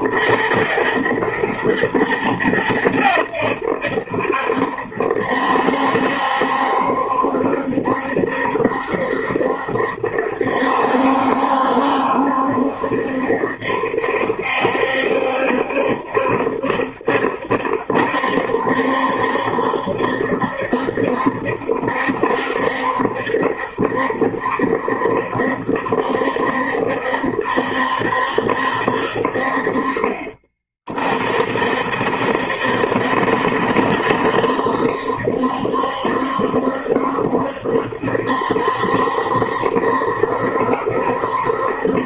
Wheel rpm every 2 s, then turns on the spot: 110, 100, 70, 70, 70, 70, 70, 70, 70, 70, 70, 70, 70, 70, 70, 30, 70, 70, 70, 70, 70.
none